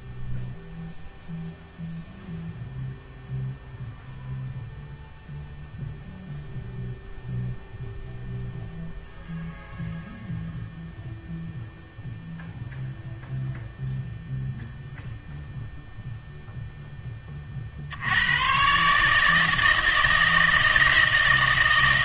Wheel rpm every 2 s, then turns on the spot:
0, 0, 0, 0, 0, 0, 0, 0, 0, 130, 160.
none